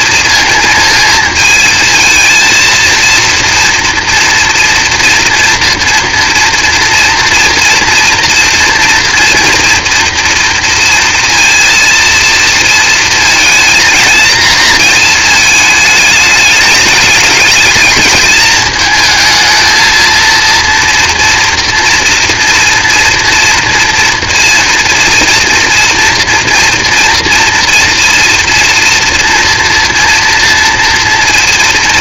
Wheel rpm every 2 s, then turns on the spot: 230, 230, 230, 230, 240, 230, 230, 230, 210, 220, 230, 230, 230, 230, 230, 230.
none